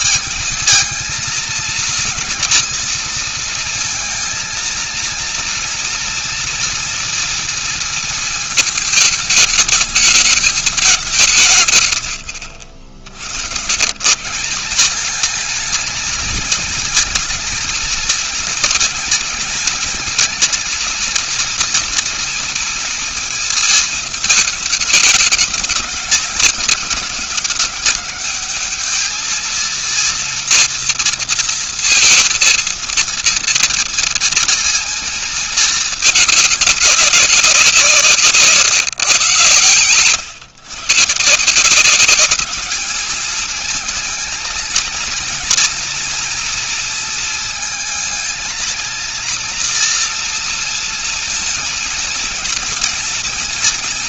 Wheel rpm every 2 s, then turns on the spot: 220, 230, 230, 240, 230, 210, 90, 180, 220, 230, 230, 230, 210, 210, 210, 230, 230, 230, 210, 150, 130, 210, 230, 240, 230, 230, 230.
none